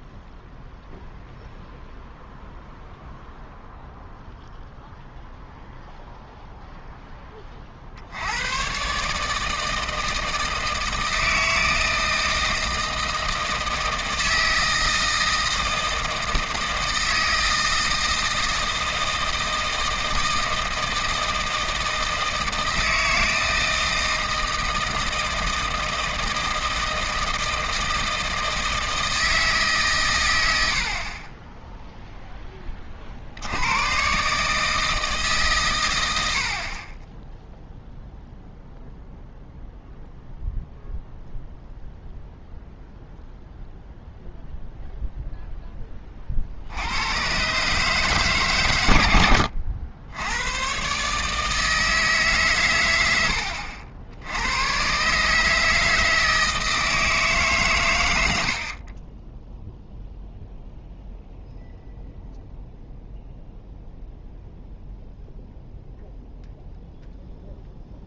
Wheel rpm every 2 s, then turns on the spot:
0, 0, 0, 0, 120, 160, 160, 160, 160, 160, 160, 160, 160, 160, 160, 70, 20, 150, 50, 0, 0, 0, 0, 50, 120, 110, 130, 110, 160, 60, 0, 0, 0, 0.
none